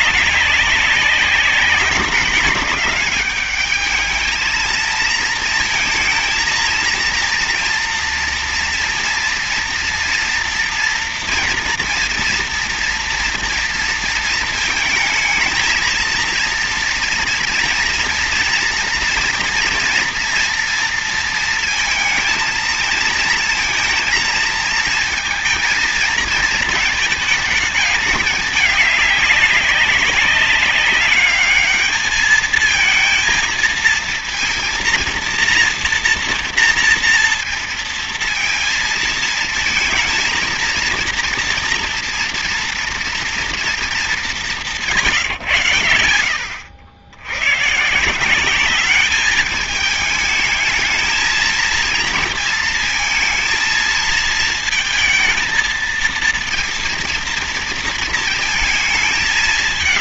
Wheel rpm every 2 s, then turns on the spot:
190, 200, 220, 230, 230, 230, 230, 220, 230, 240, 230, 230, 220, 220, 200, 200, 230, 230, 230, 230, 230, 230, 170, 90, 200, 220, 230, 220, 230, 220.
none